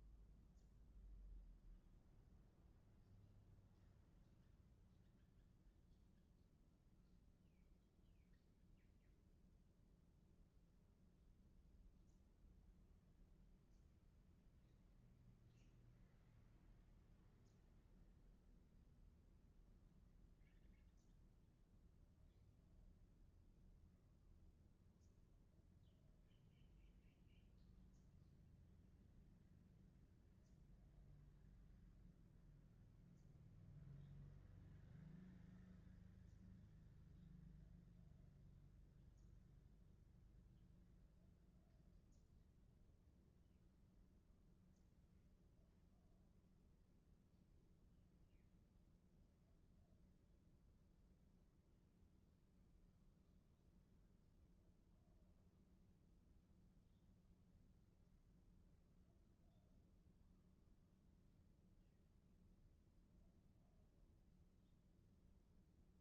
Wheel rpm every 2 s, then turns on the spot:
0, 0, 0, 0, 0, 0, 0, 0, 0, 0, 0, 0, 0, 0, 0, 0, 0, 0, 0, 0, 0, 0, 0, 0, 0, 0, 0, 0, 0, 0, 0, 0, 0.
none